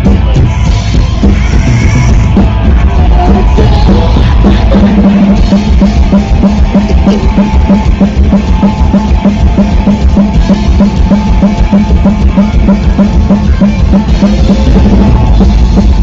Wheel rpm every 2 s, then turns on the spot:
20, 40, 10, 0, 0, 0, 0, 0.
none